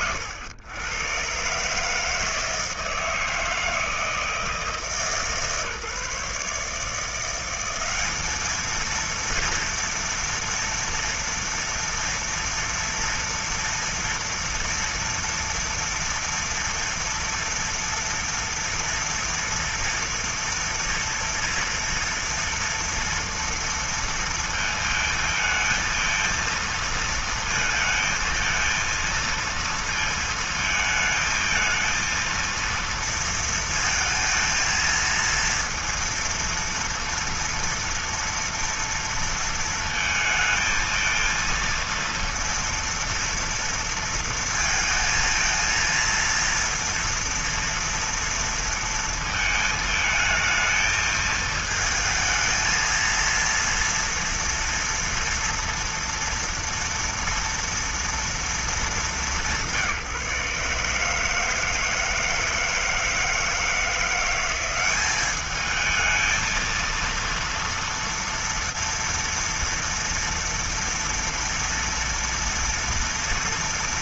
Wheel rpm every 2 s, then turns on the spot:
110, 160, 150, 150, 220, 230, 240, 230, 230, 240, 230, 230, 230, 230, 230, 220, 230, 230, 230, 230, 220, 230, 230, 230, 230, 220, 230, 230, 240, 220, 150, 160, 190, 230, 230, 240, 230.
none